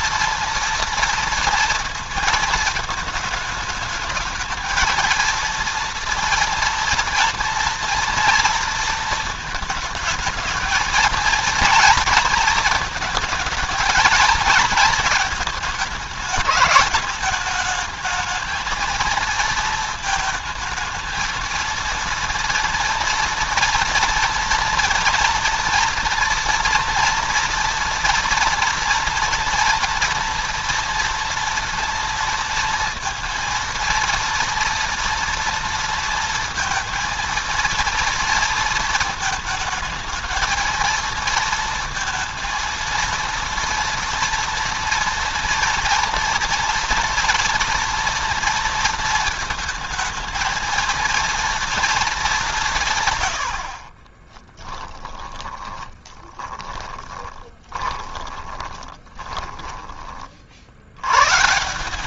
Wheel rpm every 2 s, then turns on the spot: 230, 220, 220, 240, 230, 220, 220, 220, 210, 220, 220, 230, 230, 230, 240, 240, 230, 230, 230, 230, 220, 230, 230, 240, 230, 220, 180, 10, 10, 30, 60.
54-60